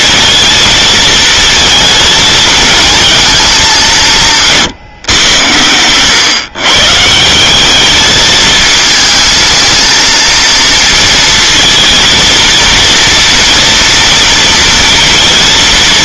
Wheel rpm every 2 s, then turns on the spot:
220, 220, 160, 140, 220, 230, 230, 230.
none